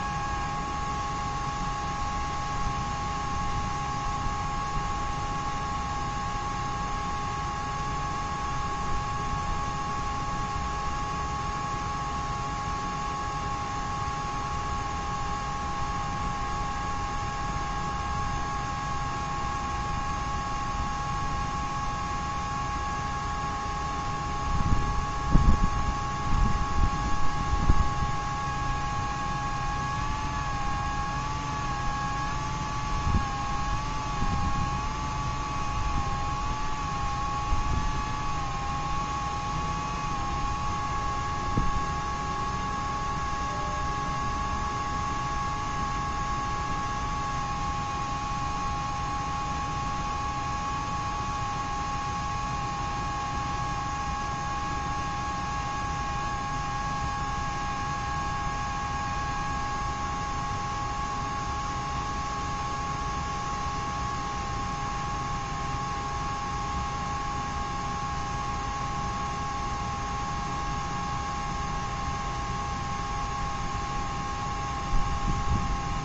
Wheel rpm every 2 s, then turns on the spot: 0, 0, 0, 0, 0, 0, 0, 0, 0, 0, 0, 0, 0, 0, 0, 0, 0, 0, 0, 0, 0, 0, 0, 0, 0, 0, 0, 0, 0, 0, 0, 0, 0, 0, 0, 0, 0, 0.
none